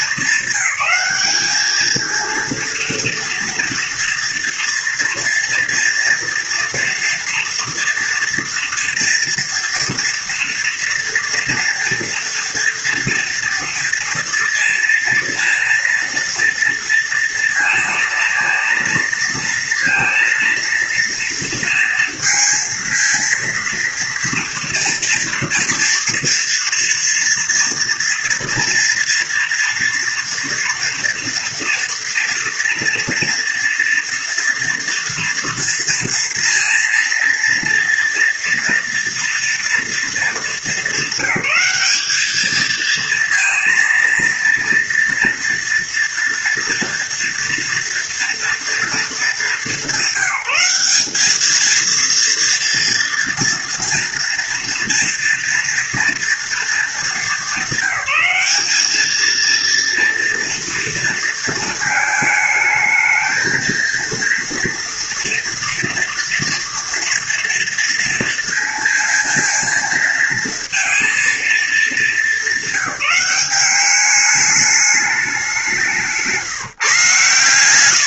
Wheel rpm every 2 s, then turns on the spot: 200, 230, 230, 230, 230, 230, 230, 230, 230, 230, 230, 230, 230, 230, 240, 230, 230, 230, 230, 230, 220, 210, 230, 230, 230, 190, 230, 230, 230, 200, 240, 220, 230, 230, 230, 230, 210, 210, 160.
none